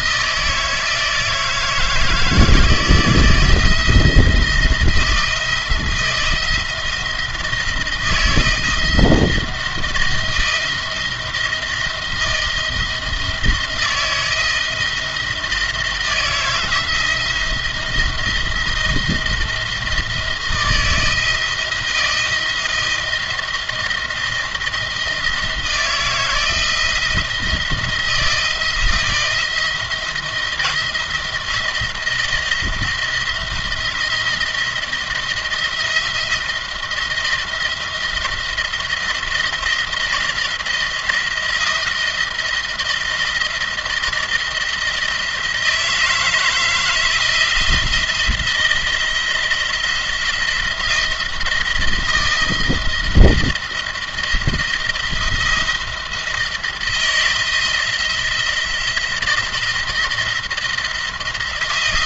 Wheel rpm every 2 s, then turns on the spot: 160, 160, 170, 170, 160, 170, 160, 160, 170, 170, 160, 160, 170, 170, 170, 170, 170, 170, 170, 170, 160, 160, 170, 160, 170, 170, 160, 170, 160, 170, 170.
none